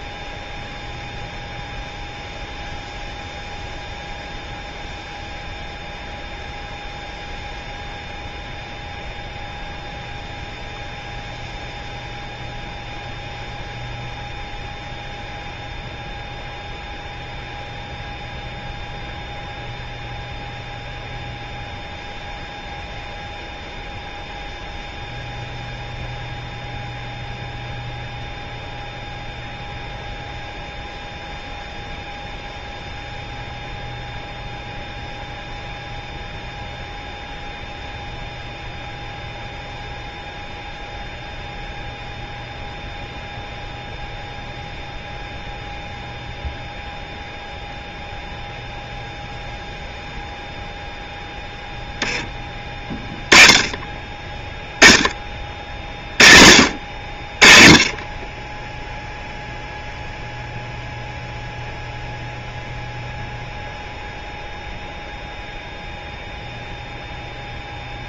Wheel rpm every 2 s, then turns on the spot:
0, 0, 0, 0, 0, 0, 0, 0, 0, 0, 0, 0, 0, 0, 0, 0, 0, 0, 0, 0, 0, 0, 0, 0, 0, 0, 30, 10, 60, 10, 0, 0, 0, 0.
none